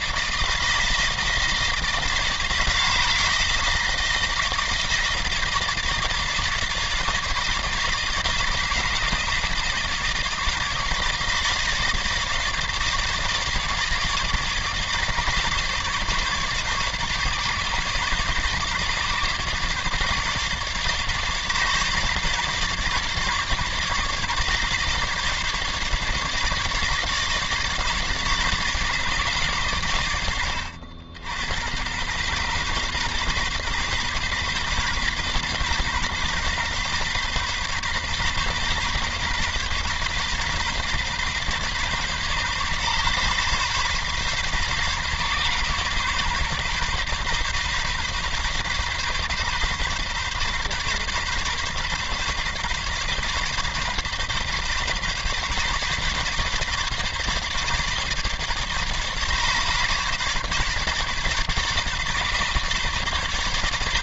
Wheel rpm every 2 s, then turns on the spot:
160, 160, 160, 160, 160, 150, 150, 150, 150, 140, 150, 150, 150, 150, 150, 80, 130, 140, 140, 130, 140, 130, 130, 130, 130, 130, 140, 130, 140, 150, 140, 140.
none